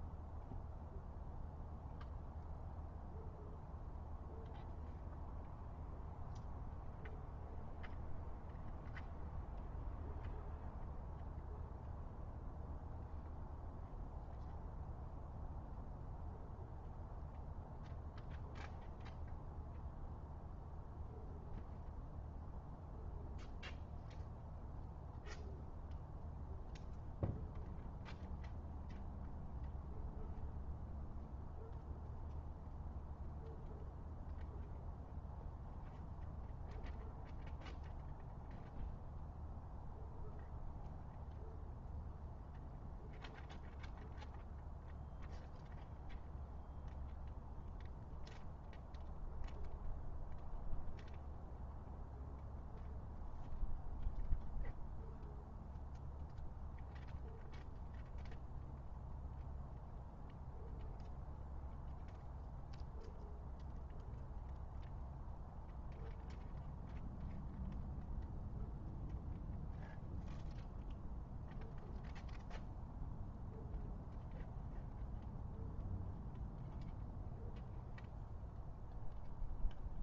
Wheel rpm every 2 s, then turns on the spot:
0, 0, 0, 0, 0, 0, 0, 0, 0, 0, 0, 0, 0, 0, 0, 0, 0, 0, 0, 0, 0, 0, 0, 0, 0, 0, 0, 0, 0, 0, 0, 0, 0, 0, 0, 0, 0, 0, 0, 0.
none